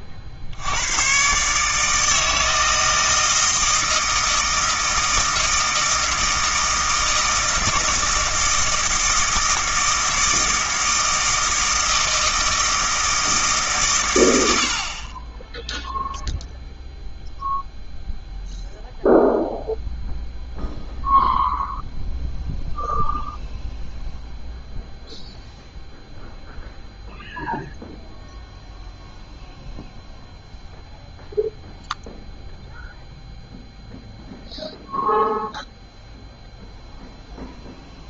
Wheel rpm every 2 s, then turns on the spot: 90, 160, 160, 160, 160, 160, 160, 60, 0, 0, 0, 0, 0, 0, 0, 0, 0, 0, 0.
none